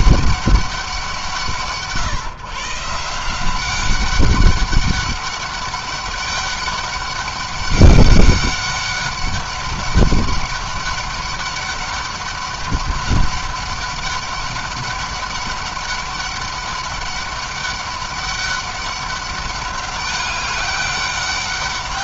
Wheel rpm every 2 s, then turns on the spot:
180, 150, 200, 200, 200, 200, 200, 200, 200, 200, 200.
none